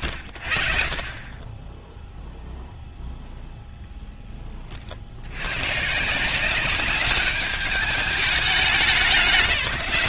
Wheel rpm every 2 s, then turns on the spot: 40, 0, 10, 160, 210.
none